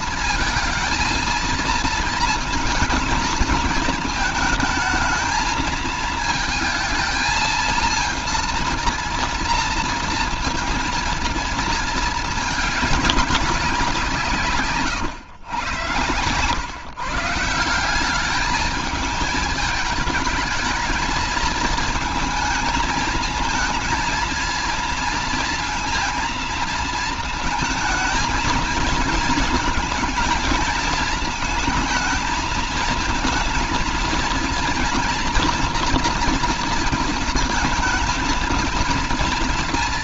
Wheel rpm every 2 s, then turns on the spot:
220, 220, 220, 230, 230, 230, 210, 140, 130, 210, 220, 220, 230, 230, 230, 220, 220, 230, 230, 230.
none